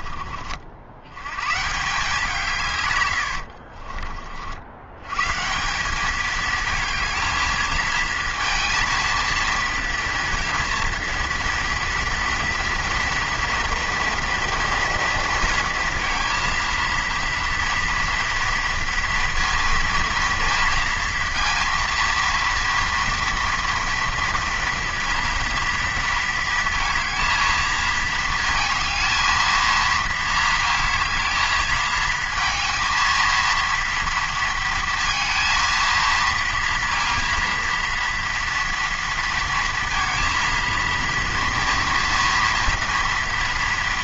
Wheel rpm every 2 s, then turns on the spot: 50, 150, 80, 220, 230, 230, 230, 230, 230, 230, 230, 230, 230, 220, 220, 220, 220, 230, 230, 240, 230, 230.
none